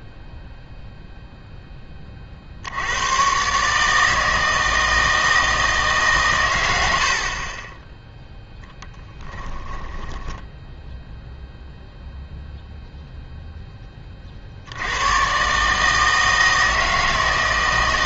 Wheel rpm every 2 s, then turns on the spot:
0, 80, 160, 100, 10, 10, 0, 80, 160.
8-10